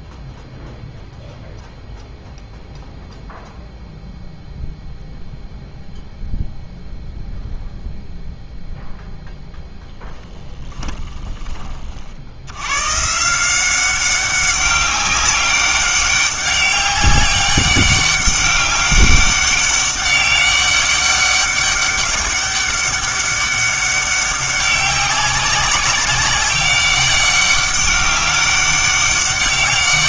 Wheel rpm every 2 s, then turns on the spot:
0, 0, 0, 0, 0, 20, 120, 200, 200, 200, 200, 200, 200, 200, 200.
10-12